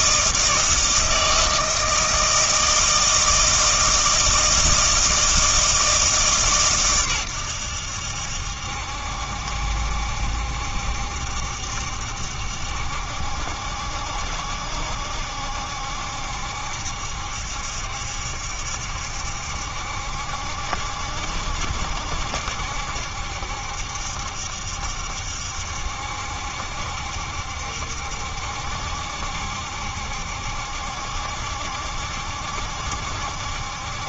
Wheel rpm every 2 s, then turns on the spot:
160, 160, 160, 130, 70, 70, 70, 60, 70, 70, 70, 70, 70, 70, 70, 70, 70.
none